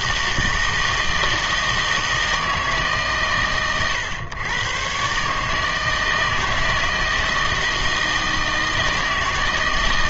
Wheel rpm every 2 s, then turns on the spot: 160, 160, 120, 160, 160.
none